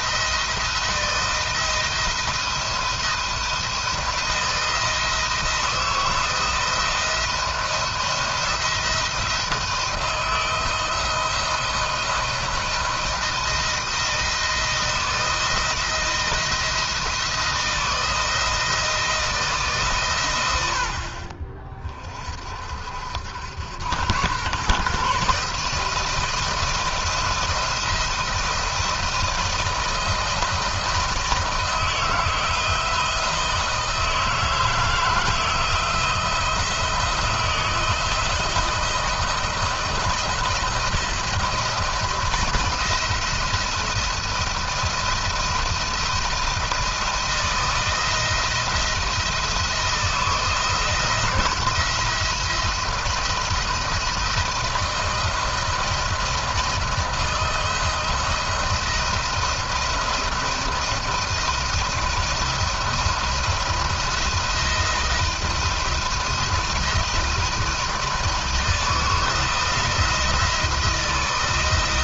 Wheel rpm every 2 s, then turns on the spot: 170, 170, 160, 170, 170, 170, 160, 160, 160, 160, 60, 60, 130, 170, 170, 170, 170, 160, 160, 170, 170, 170, 170, 170, 160, 160, 170, 170, 170, 170, 170, 170, 170, 170, 160, 170.
none